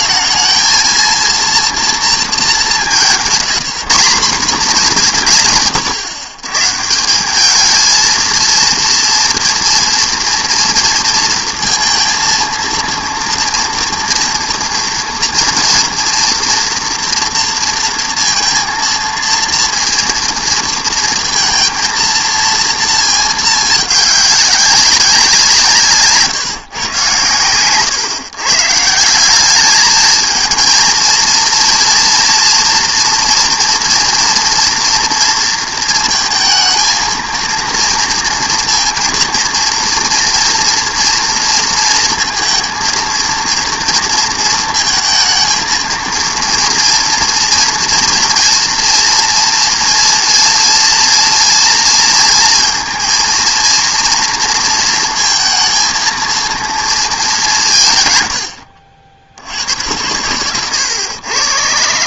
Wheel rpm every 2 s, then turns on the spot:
220, 200, 190, 140, 230, 230, 230, 230, 230, 230, 230, 230, 200, 140, 140, 230, 240, 230, 230, 230, 240, 230, 220, 230, 230, 230, 230, 230, 230, 80, 110.
none